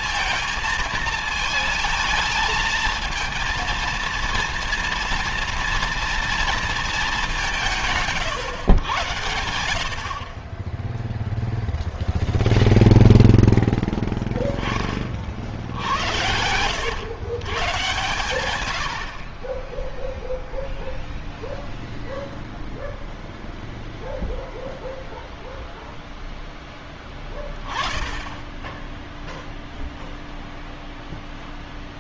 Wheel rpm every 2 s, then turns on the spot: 230, 220, 230, 220, 100, 10, 0, 20, 100, 90, 0, 0, 0, 10, 10, 0.
none